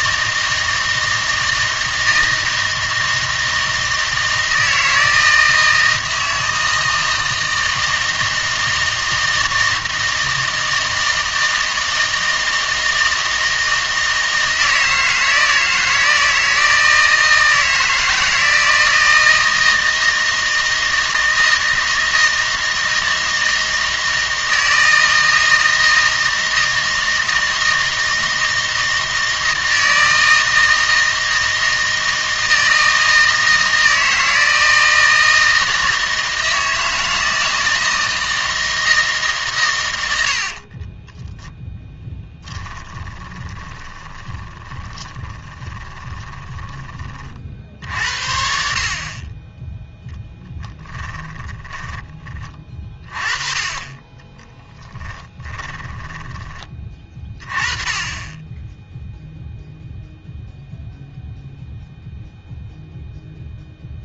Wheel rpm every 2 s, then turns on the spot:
160, 160, 160, 160, 160, 160, 160, 160, 160, 160, 160, 160, 160, 160, 160, 160, 160, 160, 160, 160, 30, 20, 20, 20, 50, 10, 30, 10, 20, 10, 0, 0.
40-48 50-52 54-56